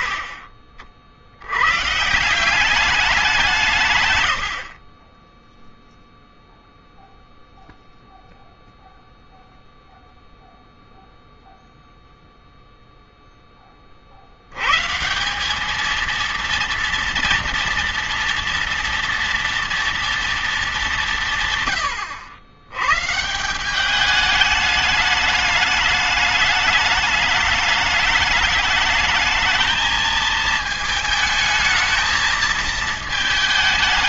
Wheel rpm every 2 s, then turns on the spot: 50, 190, 50, 0, 0, 0, 0, 140, 230, 230, 200, 120, 210, 210, 220, 220, 220.
none